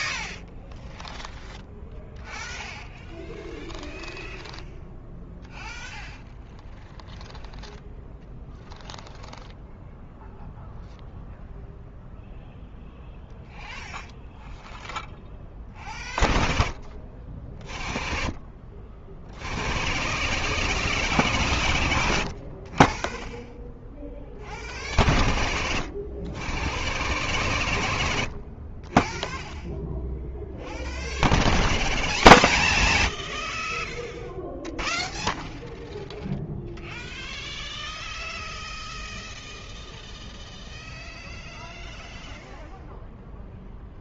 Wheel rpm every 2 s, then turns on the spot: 0, 0, 0, 0, 0, 0, 0, 0, 0, 0, 0, 0, 0, 0, 0, 0, 0, 0, 0, 0, 0, 0.
none